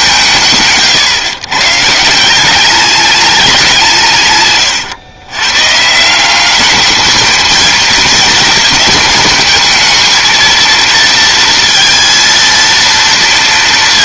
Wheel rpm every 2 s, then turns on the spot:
140, 190, 130, 200, 220, 230, 230.
4-6